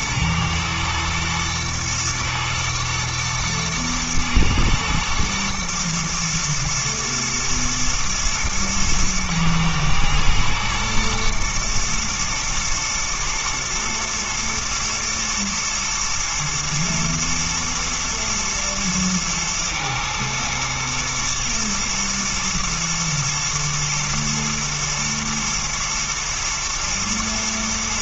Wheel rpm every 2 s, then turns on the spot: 110, 110, 110, 120, 110, 110, 120, 110, 110, 110, 120, 120, 120, 110.
none